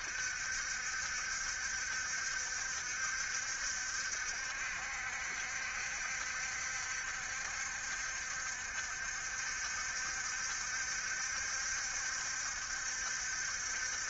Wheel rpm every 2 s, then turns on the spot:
70, 60, 70, 70, 60, 70, 70.
none